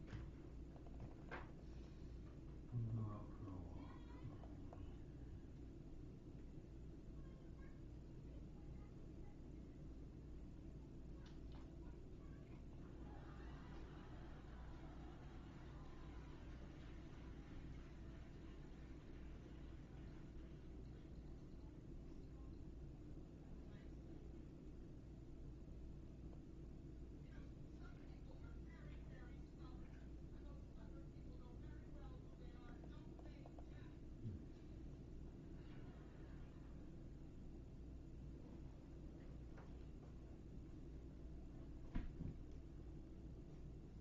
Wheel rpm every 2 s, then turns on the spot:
0, 0, 0, 0, 0, 0, 0, 0, 0, 0, 0, 0, 0, 0, 0, 0, 0, 0, 0, 0, 0, 0.
none